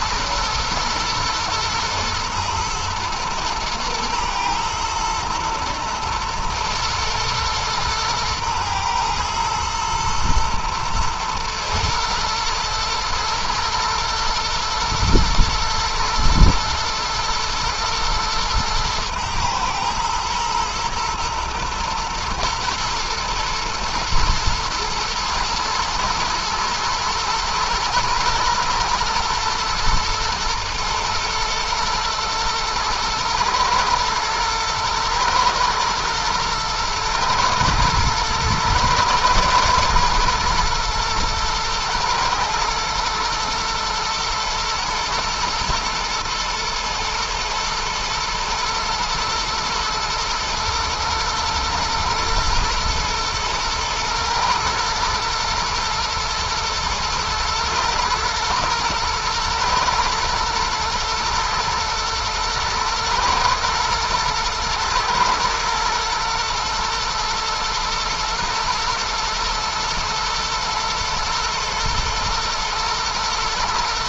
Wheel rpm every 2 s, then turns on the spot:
120, 120, 110, 110, 110, 120, 110, 110, 110, 110, 110, 120, 110, 110, 120, 110, 110, 110, 110, 120, 120, 110, 120, 120, 110, 110, 110, 110, 110, 120, 120, 120, 110, 120, 110, 110, 120.
none